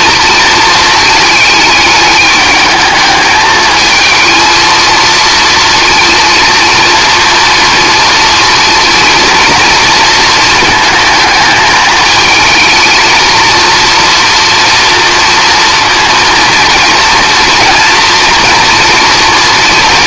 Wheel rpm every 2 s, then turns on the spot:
230, 210, 230, 230, 230, 220, 220, 230, 230, 240.
none